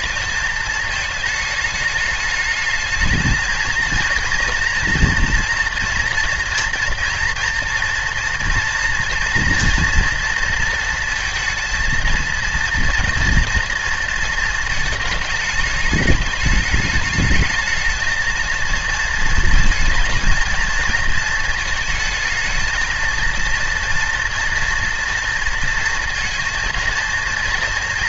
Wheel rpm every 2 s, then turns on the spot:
220, 220, 240, 230, 230, 230, 230, 220, 210, 220, 220, 220, 230, 230.
none